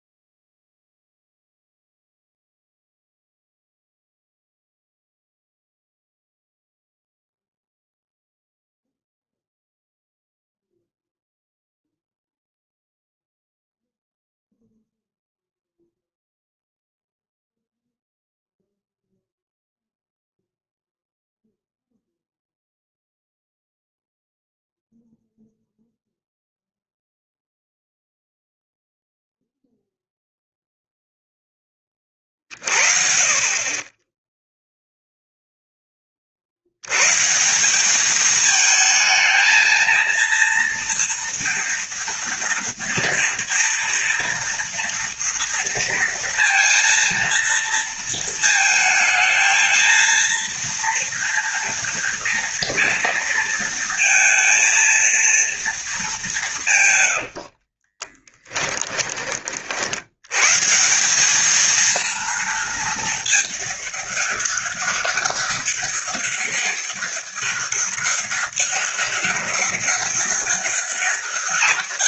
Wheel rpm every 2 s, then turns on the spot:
0, 0, 0, 0, 0, 0, 0, 0, 0, 0, 0, 0, 0, 0, 0, 0, 40, 0, 90, 220, 230, 230, 230, 230, 220, 230, 230, 230, 130, 10, 160, 220, 200, 200, 200, 200.
56-60